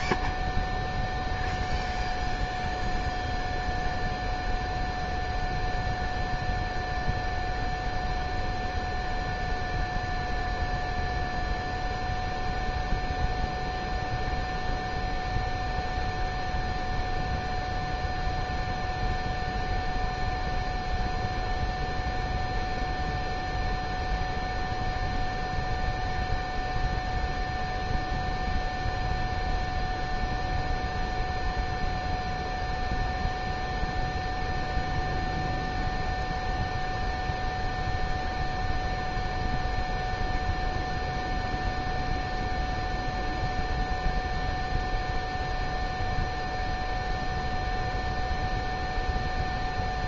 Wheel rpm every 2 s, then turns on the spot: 0, 0, 0, 0, 0, 0, 0, 0, 0, 0, 0, 0, 0, 0, 0, 0, 0, 0, 0, 0, 0, 0, 0, 0, 0.
none